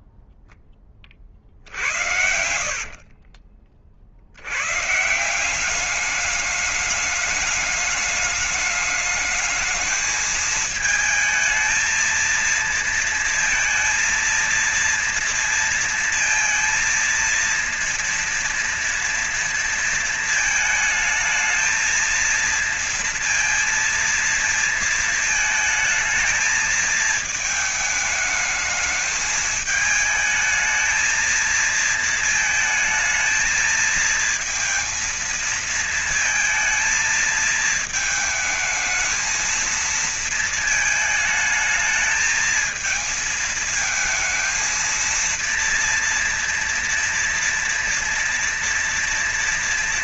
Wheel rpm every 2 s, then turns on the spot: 0, 70, 70, 210, 210, 220, 230, 230, 230, 230, 230, 230, 230, 220, 220, 220, 220, 220, 230, 220, 230, 220, 220, 230, 230.
2-4